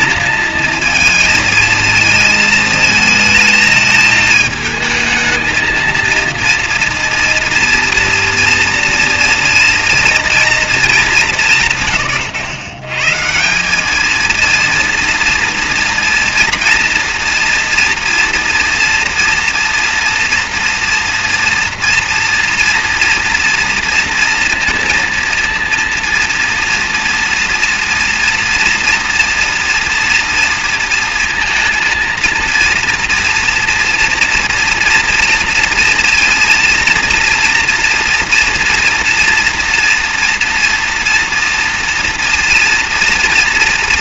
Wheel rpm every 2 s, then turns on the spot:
220, 220, 220, 230, 230, 230, 130, 230, 230, 240, 230, 240, 230, 230, 240, 230, 230, 230, 230, 230, 230, 230.
none